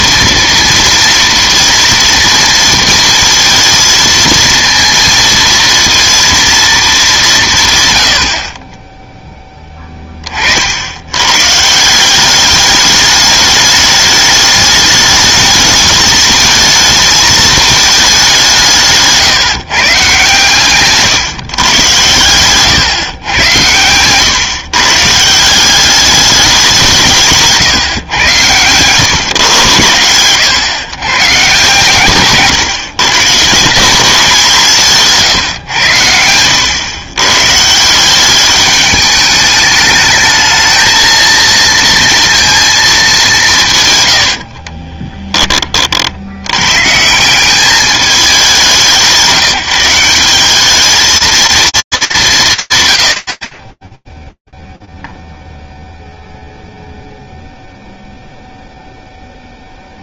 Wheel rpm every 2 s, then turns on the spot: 230, 230, 230, 220, 30, 50, 200, 210, 220, 170, 140, 120, 130, 190, 120, 120, 140, 180, 110, 200, 220, 230, 50, 110, 190, 210, 170, 0, 0, 10.
28-30 32-34 44-46